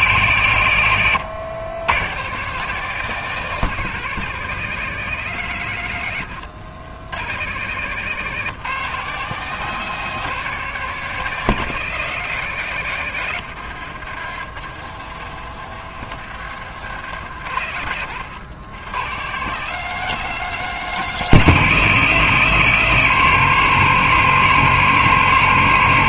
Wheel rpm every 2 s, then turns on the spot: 120, 170, 170, 110, 170, 170, 140, 70, 90, 130, 170, 160, 160.
14-16